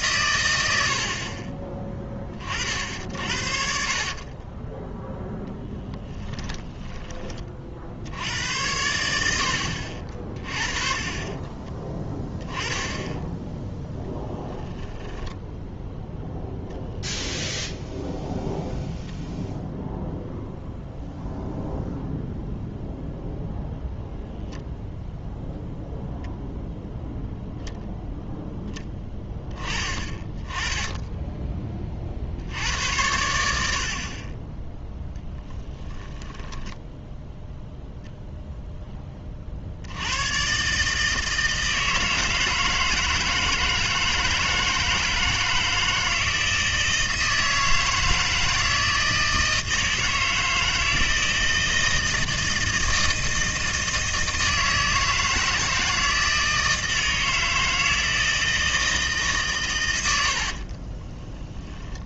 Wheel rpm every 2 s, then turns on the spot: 80, 60, 10, 20, 90, 30, 10, 10, 0, 0, 0, 0, 0, 0, 10, 20, 80, 10, 10, 10, 140, 160, 170, 160, 160, 160, 160, 160, 160, 160, 40.
4-8 14-16 36-38 60-62